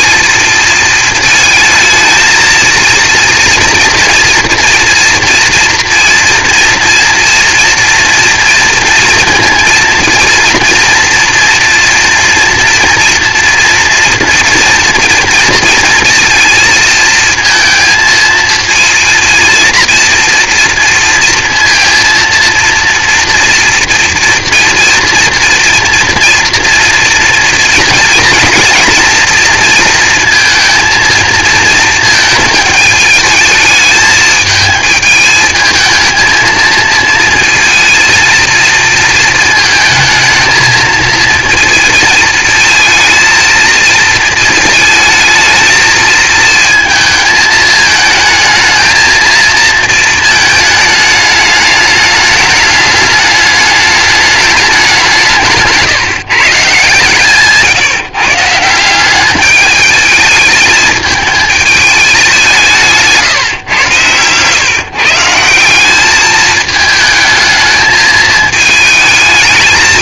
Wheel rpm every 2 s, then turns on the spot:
230, 230, 230, 230, 230, 230, 230, 240, 230, 230, 230, 230, 230, 230, 230, 230, 220, 220, 220, 230, 220, 220, 230, 230, 220, 220, 210, 210, 150, 150, 210, 190, 110, 220, 220.
none